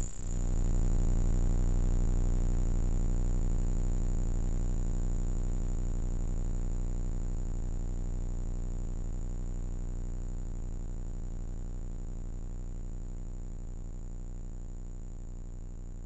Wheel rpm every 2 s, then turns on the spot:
0, 0, 0, 0, 0, 0, 0, 10.
14-16